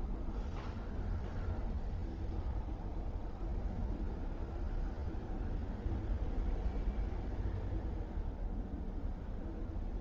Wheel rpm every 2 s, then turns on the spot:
0, 0, 0, 0, 0.
none